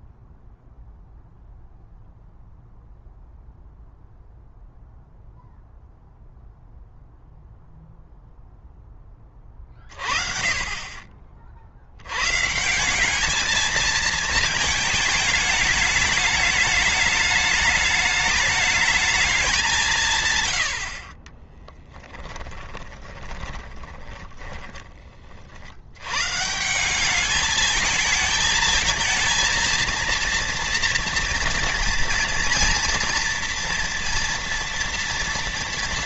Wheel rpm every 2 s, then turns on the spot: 0, 0, 0, 0, 20, 40, 200, 210, 210, 210, 50, 20, 30, 190, 220, 230, 240, 230.
22-24